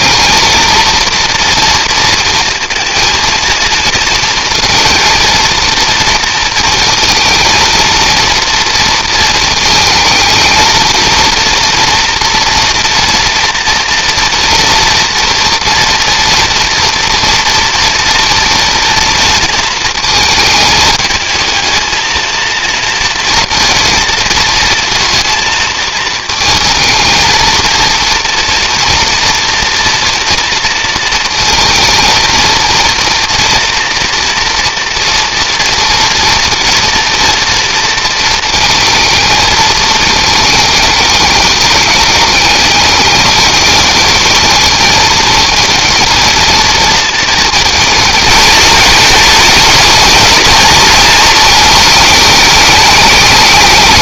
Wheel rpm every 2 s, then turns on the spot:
230, 230, 230, 230, 230, 220, 240, 230, 230, 230, 210, 230, 220, 220, 230, 230, 230, 230, 230, 220, 220, 210, 210, 230, 230, 230, 210.
none